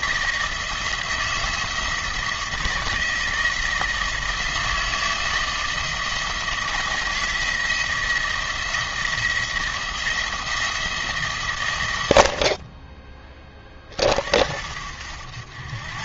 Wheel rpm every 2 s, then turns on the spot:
170, 160, 160, 170, 170, 160, 30, 70.
none